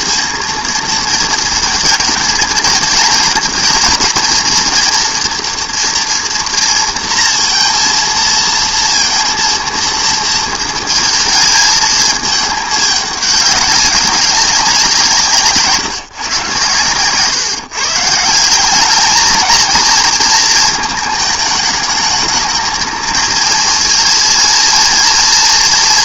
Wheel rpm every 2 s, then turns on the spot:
230, 220, 230, 230, 230, 230, 210, 190, 130, 190, 220, 220, 230.
none